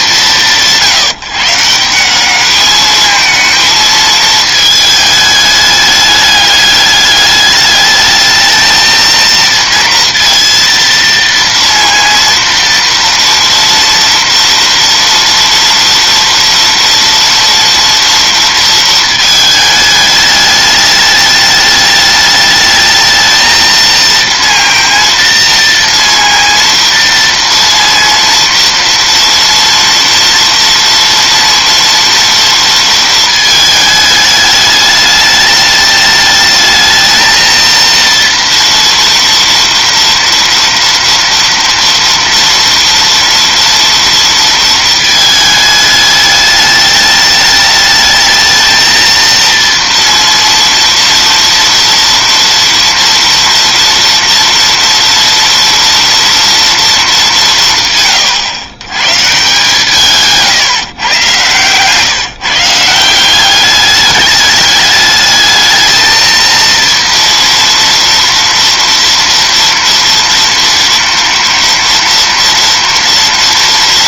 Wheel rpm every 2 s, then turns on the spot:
170, 210, 220, 210, 220, 230, 230, 230, 230, 230, 210, 210, 230, 230, 230, 230, 230, 210, 220, 230, 230, 230, 230, 210, 220, 230, 230, 230, 230, 120, 150, 170, 210, 230, 230, 230, 230.
none